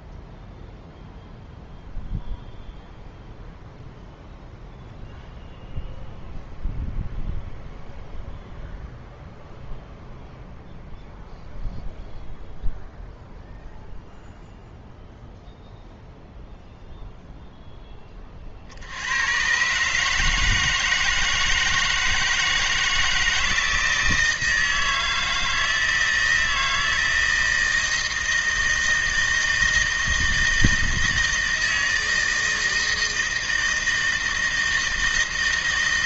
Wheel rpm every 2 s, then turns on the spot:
0, 0, 0, 0, 0, 0, 0, 0, 0, 30, 150, 160, 160, 160, 160, 160, 160, 160.
none